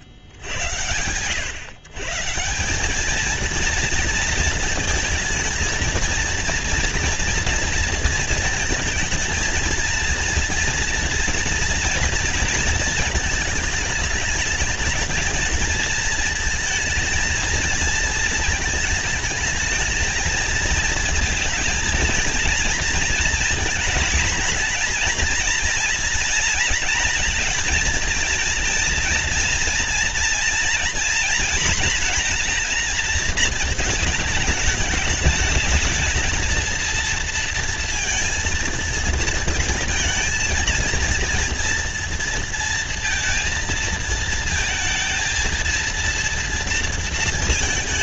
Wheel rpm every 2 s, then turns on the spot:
100, 170, 230, 230, 230, 230, 230, 210, 220, 220, 230, 230, 230, 230, 230, 240, 240, 210, 220, 230, 230, 230, 220, 230.
none